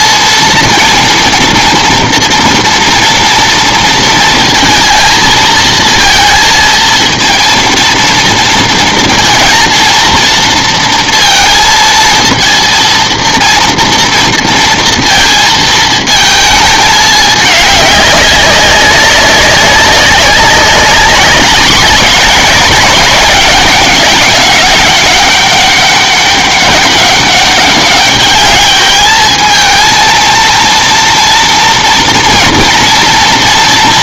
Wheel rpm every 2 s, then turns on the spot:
230, 230, 230, 230, 230, 230, 230, 230, 220, 200, 190, 200, 200, 200, 210, 230, 230.
none